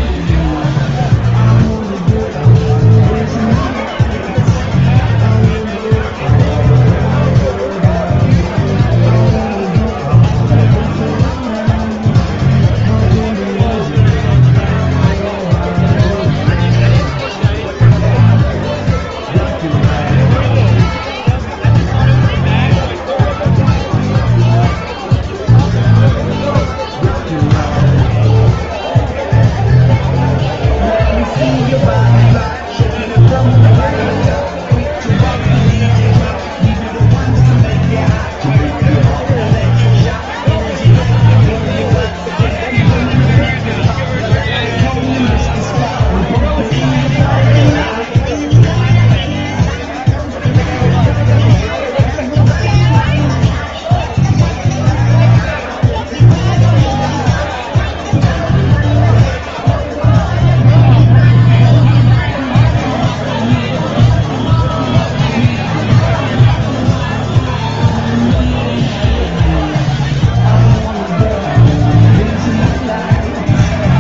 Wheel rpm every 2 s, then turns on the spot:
0, 0, 0, 0, 0, 0, 0, 0, 0, 0, 0, 0, 0, 0, 0, 0, 0, 0, 0, 0, 0, 0, 0, 0, 0, 0, 0, 0, 0, 0, 0, 0, 0, 0, 0, 0, 0.
none